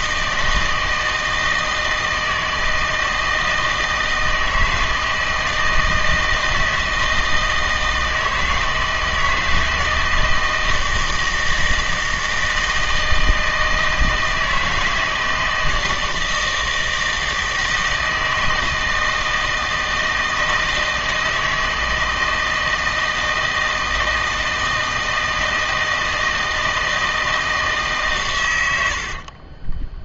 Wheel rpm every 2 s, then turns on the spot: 160, 160, 160, 160, 160, 160, 160, 160, 160, 160, 160, 160, 160, 160, 110.
none